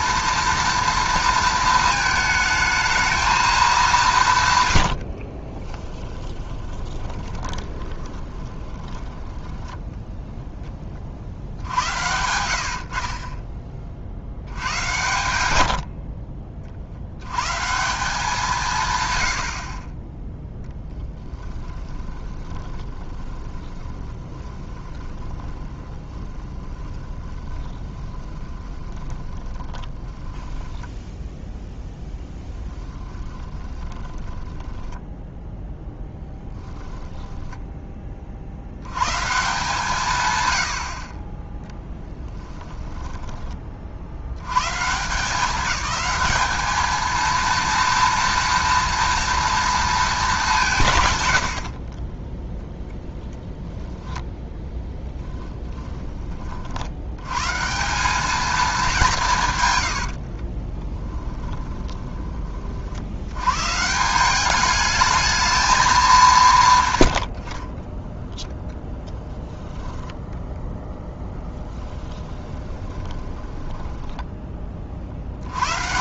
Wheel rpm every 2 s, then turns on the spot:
230, 220, 90, 20, 10, 20, 60, 100, 60, 150, 10, 20, 20, 10, 20, 0, 10, 10, 10, 90, 70, 10, 150, 220, 230, 140, 0, 10, 70, 200, 20, 60, 210, 130, 0, 10, 20, 40.
4-10 20-30 32-38 42-44 60-62 66-68 72-74